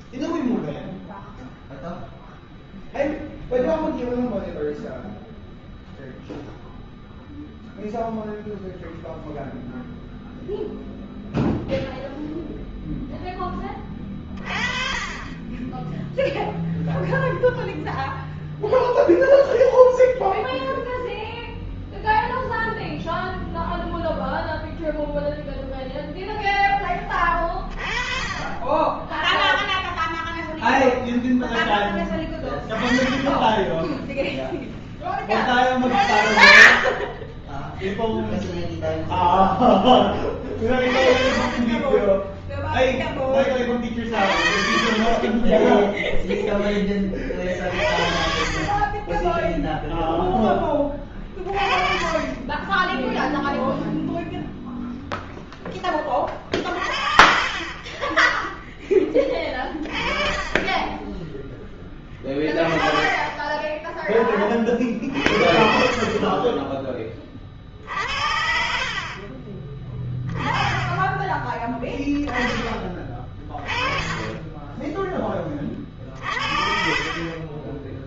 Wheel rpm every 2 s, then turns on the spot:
0, 0, 0, 0, 0, 0, 20, 20, 0, 0, 0, 0, 0, 20, 0, 0, 20, 20, 10, 0, 40, 10, 30, 30, 20, 20, 10, 0, 40, 10, 10, 20, 30, 30, 60, 20, 10, 10, 40.
60-62 70-72 76-78